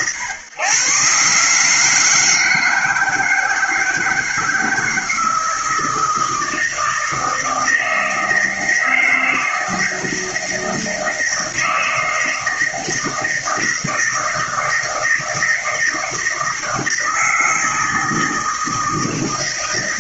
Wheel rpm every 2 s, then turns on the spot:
130, 160, 160, 160, 160, 160, 160, 160, 160, 160.
none